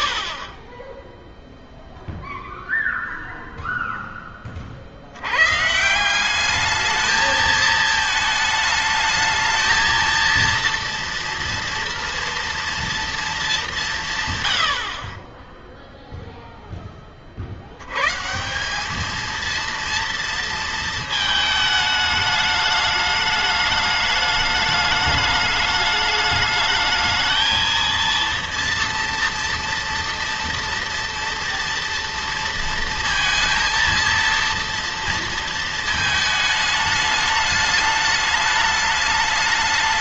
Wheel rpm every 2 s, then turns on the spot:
50, 0, 30, 200, 220, 230, 230, 100, 10, 180, 230, 210, 210, 220, 230, 230, 230, 230, 220, 210.
none